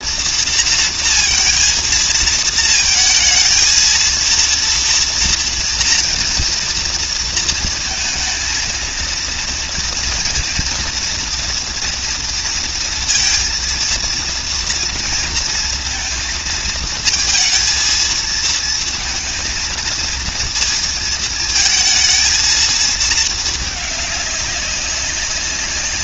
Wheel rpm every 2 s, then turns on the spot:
230, 220, 230, 230, 230, 230, 230, 230, 220, 230, 230, 220, 200.
none